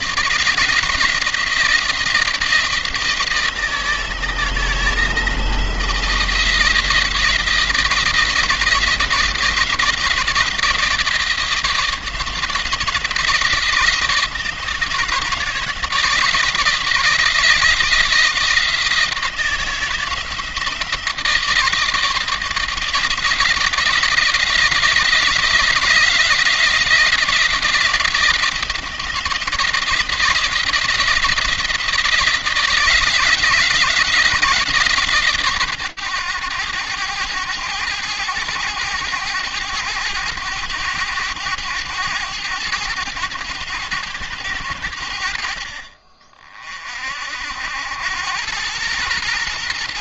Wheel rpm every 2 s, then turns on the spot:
160, 170, 160, 170, 160, 170, 160, 160, 160, 160, 160, 160, 170, 170, 160, 170, 160, 140, 100, 100, 100, 100, 90, 50, 110.
none